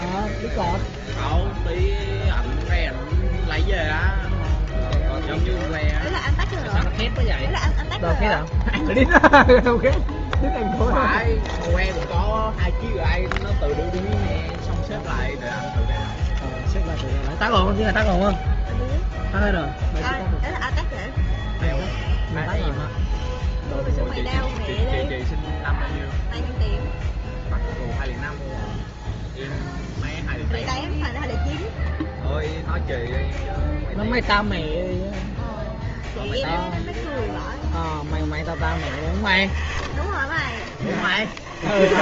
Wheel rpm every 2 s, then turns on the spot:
0, 0, 0, 0, 0, 0, 0, 0, 0, 0, 0, 0, 0, 0, 0, 0, 0, 0, 0, 0, 0.
none